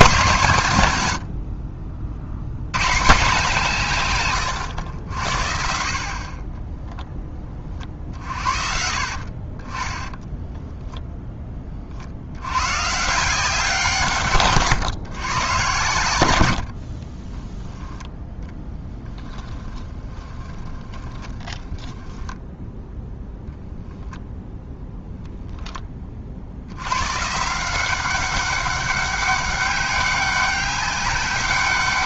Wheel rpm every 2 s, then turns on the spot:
110, 130, 90, 10, 50, 0, 140, 130, 40, 10, 20, 0, 0, 110, 200, 200.
16-22